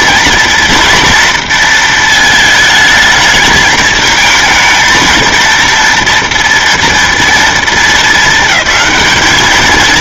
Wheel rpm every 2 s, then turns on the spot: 230, 220, 220, 230, 220.
none